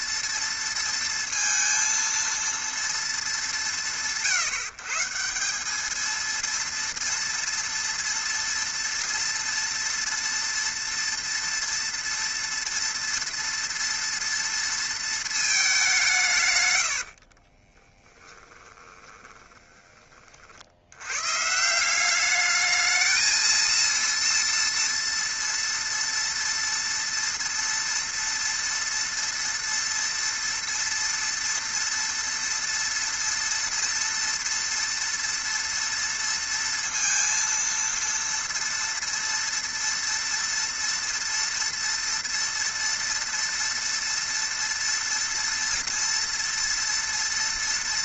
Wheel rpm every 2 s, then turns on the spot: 230, 230, 160, 230, 230, 230, 240, 230, 120, 20, 80, 210, 230, 230, 230, 230, 230, 230, 230, 230, 230, 230, 230, 240.
16-20